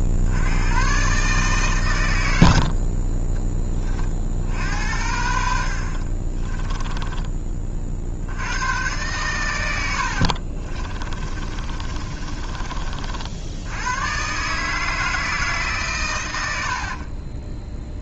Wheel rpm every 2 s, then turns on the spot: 50, 110, 50, 30, 80, 50, 40, 150, 70.
6-8 10-12 16-18